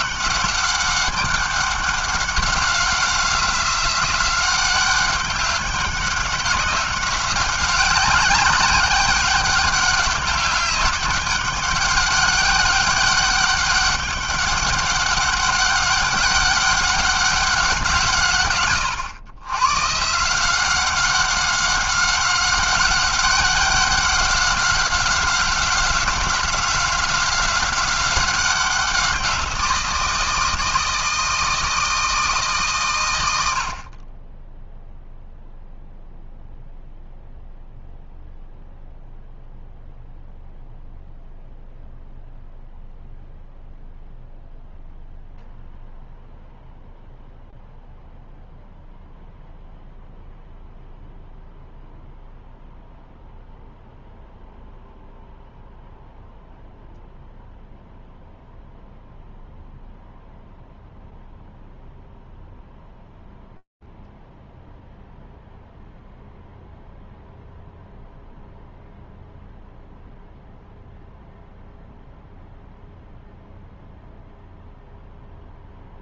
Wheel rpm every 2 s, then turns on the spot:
200, 190, 190, 190, 190, 200, 200, 200, 200, 120, 180, 190, 190, 190, 190, 160, 150, 10, 0, 0, 0, 0, 0, 0, 0, 0, 0, 0, 0, 0, 0, 0, 0, 0, 0, 0, 0, 0.
none